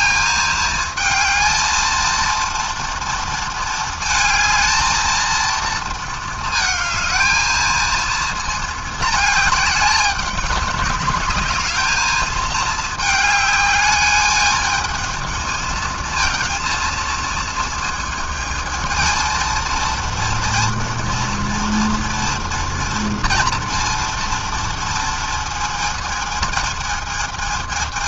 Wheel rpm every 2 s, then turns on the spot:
220, 230, 230, 220, 210, 200, 210, 220, 220, 220, 240, 230, 230, 220.
none